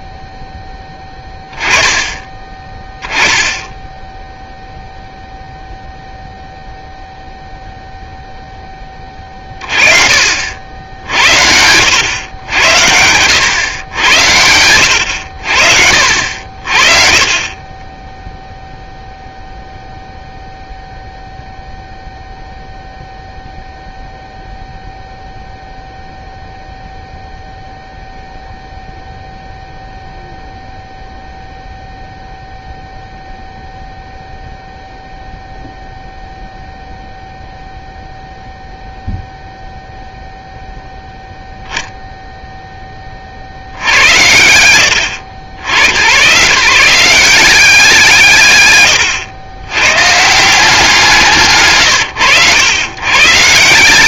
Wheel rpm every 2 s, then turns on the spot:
10, 20, 0, 0, 30, 80, 120, 70, 20, 0, 0, 0, 0, 0, 0, 0, 0, 0, 0, 0, 0, 50, 80, 180, 110, 140, 120.
none